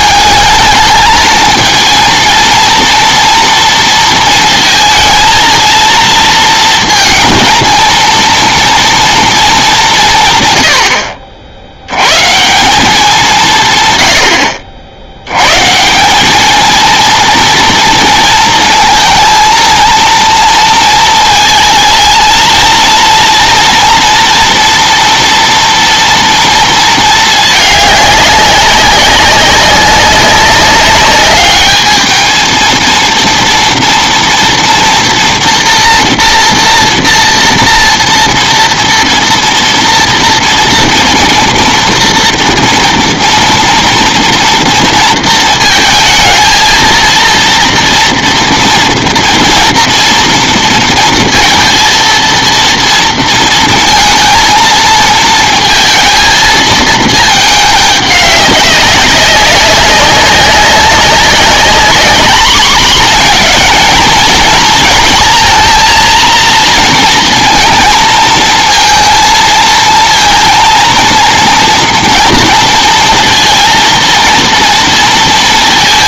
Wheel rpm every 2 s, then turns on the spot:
210, 230, 230, 230, 230, 110, 180, 60, 220, 230, 230, 230, 230, 230, 200, 200, 220, 230, 230, 230, 240, 240, 230, 220, 240, 230, 230, 230, 220, 200, 200, 220, 230, 230, 230, 230, 230, 230.
none